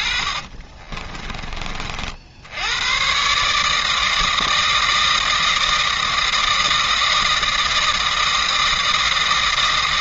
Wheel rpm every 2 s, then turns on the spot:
40, 90, 160, 160, 160.
0-2